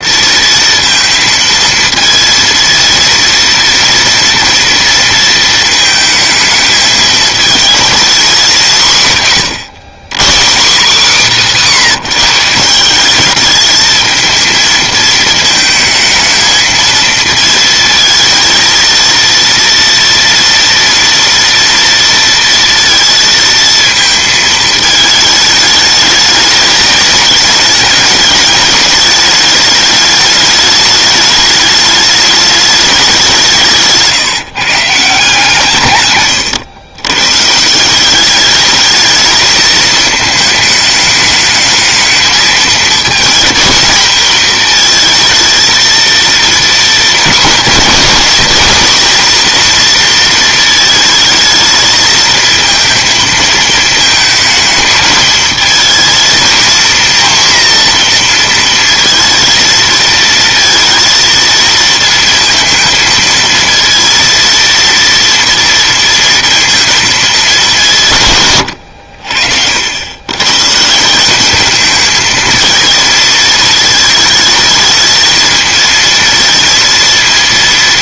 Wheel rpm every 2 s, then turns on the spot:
230, 230, 230, 220, 190, 190, 180, 220, 220, 220, 230, 230, 220, 210, 210, 210, 210, 150, 120, 210, 220, 230, 230, 240, 240, 220, 220, 220, 230, 230, 230, 230, 230, 230, 110, 150, 220, 220, 230.
none